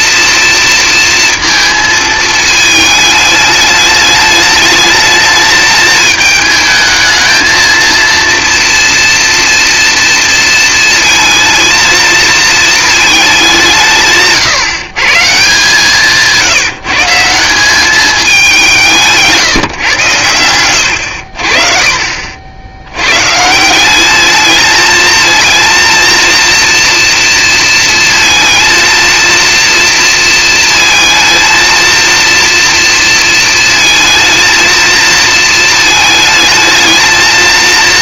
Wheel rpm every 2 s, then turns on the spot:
230, 220, 220, 220, 230, 230, 220, 130, 170, 180, 90, 80, 220, 230, 230, 230, 230, 230, 220.
none